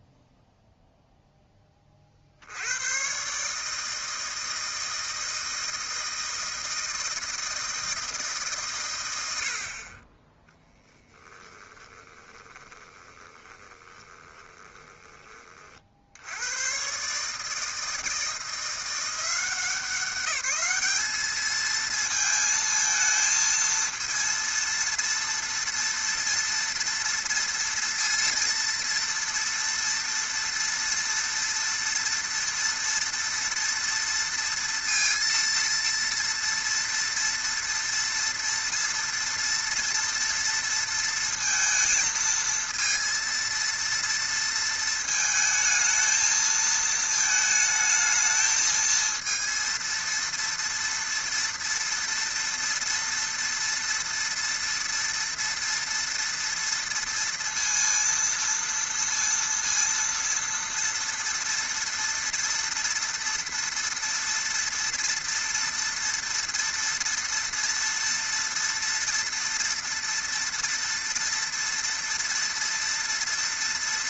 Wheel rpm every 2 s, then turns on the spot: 0, 70, 160, 160, 150, 10, 20, 20, 100, 160, 200, 220, 230, 230, 230, 230, 230, 230, 230, 230, 230, 230, 230, 220, 220, 230, 230, 230, 230, 230, 230, 230, 230, 230, 230, 230, 230.
12-16